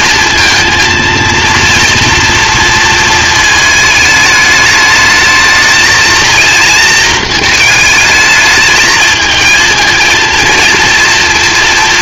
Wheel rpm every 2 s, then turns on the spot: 230, 230, 210, 230, 220, 230.
none